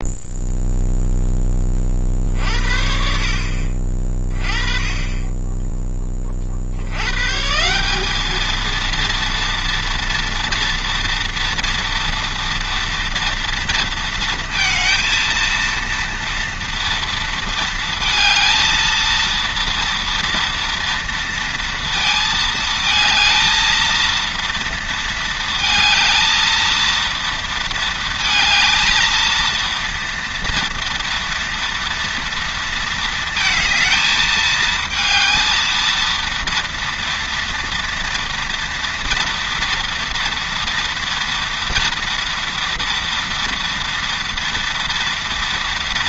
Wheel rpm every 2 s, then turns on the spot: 0, 50, 20, 70, 230, 230, 230, 230, 230, 230, 240, 220, 230, 230, 220, 230, 230, 220, 230, 230, 230, 230, 230.
none